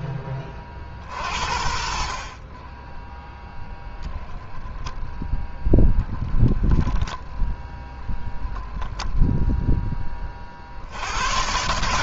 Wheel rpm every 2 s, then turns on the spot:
50, 10, 0, 10, 0, 70.
none